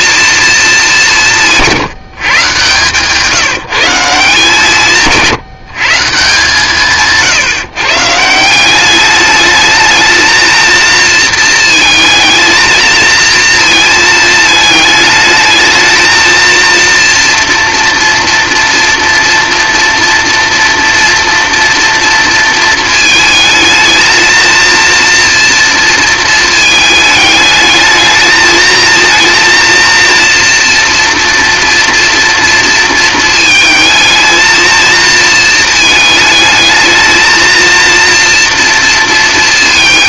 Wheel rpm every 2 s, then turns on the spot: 210, 150, 170, 160, 190, 230, 230, 220, 230, 230, 230, 220, 230, 220, 220, 230, 230, 230, 220, 230.
none